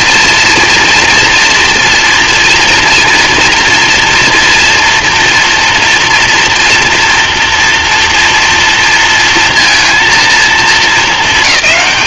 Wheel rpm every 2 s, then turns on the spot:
230, 240, 230, 230, 230, 220.
none